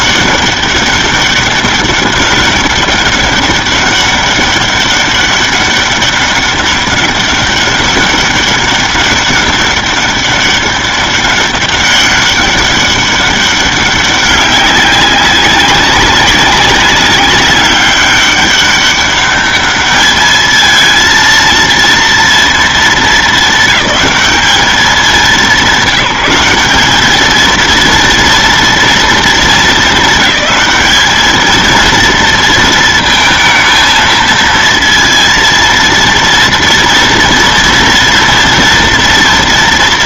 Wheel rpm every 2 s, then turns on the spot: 200, 200, 200, 200, 200, 200, 200, 200, 190, 200, 220, 230, 210, 190, 230, 220, 230, 230, 230, 230.
none